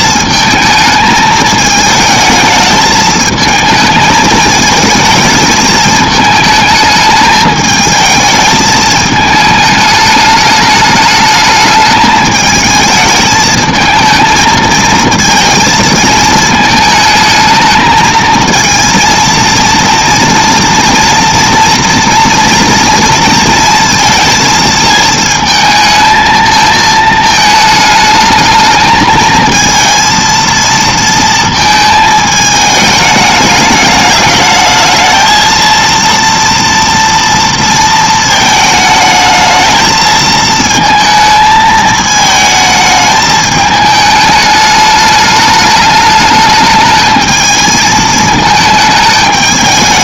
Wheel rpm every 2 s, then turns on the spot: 220, 220, 220, 210, 220, 210, 220, 220, 220, 230, 230, 230, 230, 220, 220, 230, 210, 210, 230, 220, 220, 220, 210, 210, 220.
none